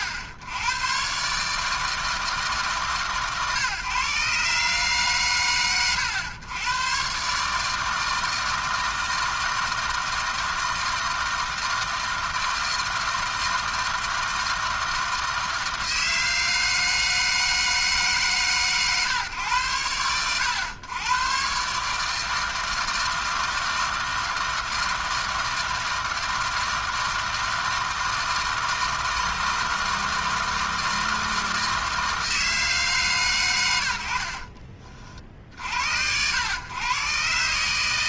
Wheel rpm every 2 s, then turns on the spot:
100, 150, 140, 110, 160, 160, 160, 160, 160, 130, 110, 160, 160, 160, 160, 160, 150, 40, 120.
34-36